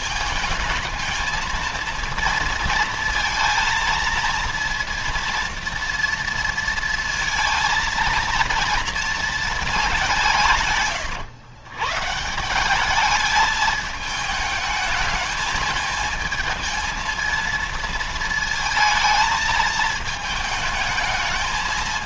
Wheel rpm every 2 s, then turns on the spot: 220, 230, 230, 230, 230, 130, 200, 220, 230, 220, 220.
none